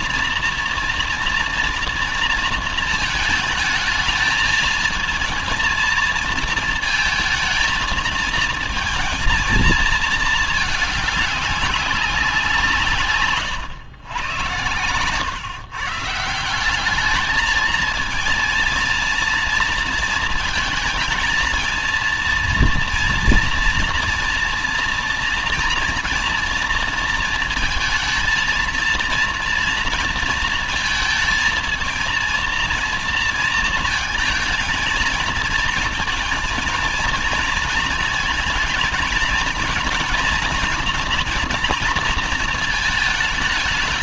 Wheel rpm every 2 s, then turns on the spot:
230, 220, 220, 220, 230, 210, 150, 110, 200, 230, 230, 230, 230, 230, 230, 230, 230, 230, 230, 220, 240, 220.
none